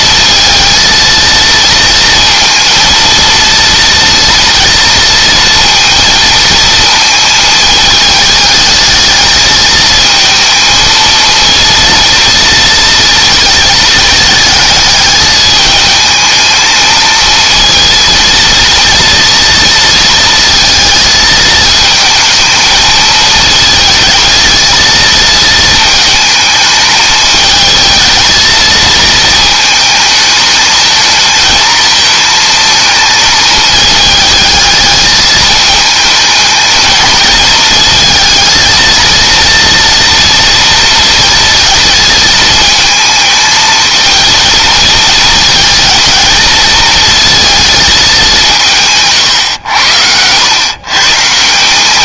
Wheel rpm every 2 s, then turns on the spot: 220, 230, 230, 220, 220, 230, 230, 210, 220, 230, 230, 220, 220, 210, 220, 220, 220, 210, 220, 230, 230, 220, 230, 230, 160, 130.
none